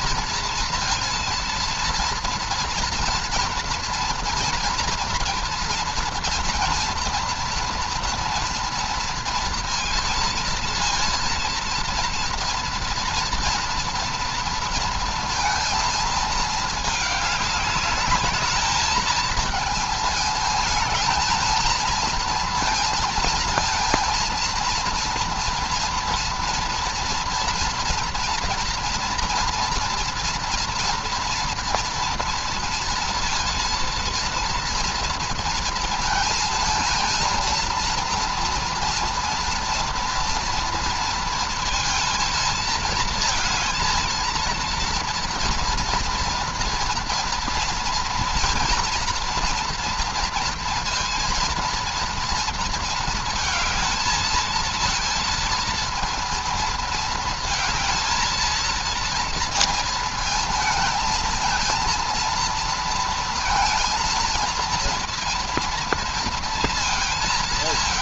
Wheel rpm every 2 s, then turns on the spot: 230, 230, 230, 230, 230, 230, 230, 230, 220, 210, 220, 230, 230, 230, 240, 230, 230, 230, 230, 230, 230, 220, 230, 230, 230, 230, 230, 220, 230, 230, 230, 230, 230, 230.
none